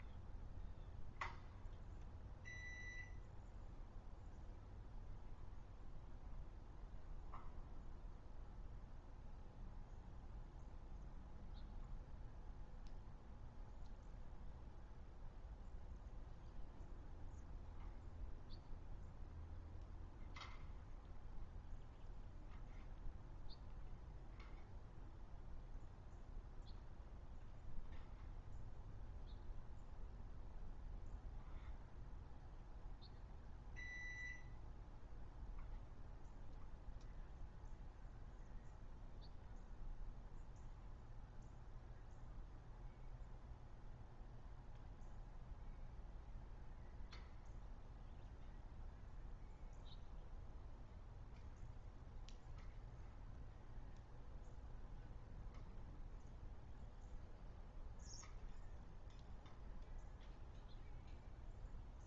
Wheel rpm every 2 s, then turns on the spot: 0, 0, 0, 0, 0, 0, 0, 0, 0, 0, 0, 0, 0, 0, 0, 0, 0, 0, 0, 0, 0, 0, 0, 0, 0, 0, 0, 0, 0, 0, 0.
none